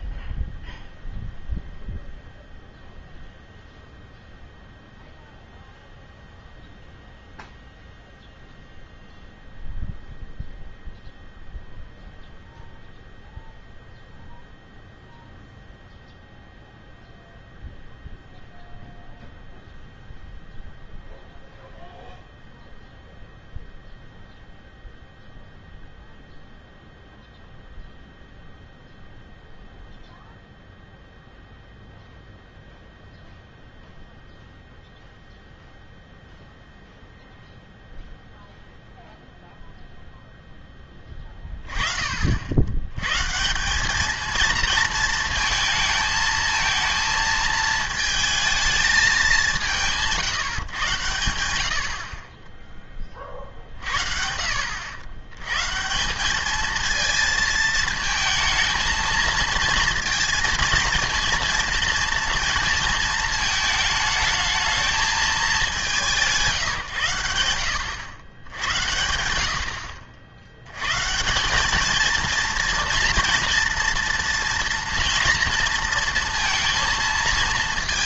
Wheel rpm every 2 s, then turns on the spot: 0, 0, 0, 0, 0, 0, 0, 0, 0, 0, 0, 0, 0, 0, 0, 0, 0, 0, 0, 0, 10, 90, 230, 230, 220, 130, 20, 80, 220, 220, 230, 230, 220, 160, 90, 100, 230, 230, 230.
none